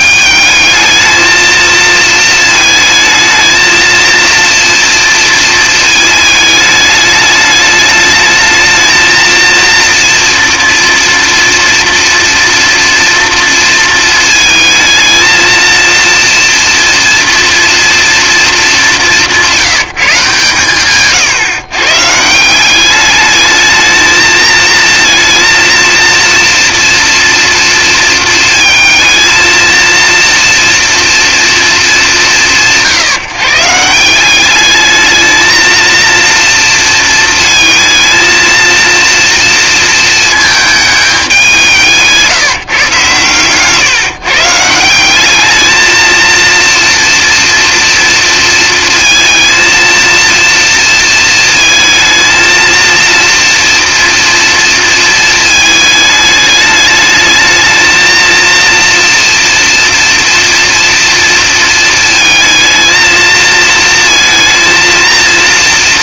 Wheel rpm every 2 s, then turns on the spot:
210, 220, 230, 210, 220, 240, 230, 220, 230, 200, 140, 190, 230, 230, 230, 240, 130, 210, 230, 230, 210, 140, 170, 230, 230, 230, 230, 230, 210, 240, 230, 220, 230.
none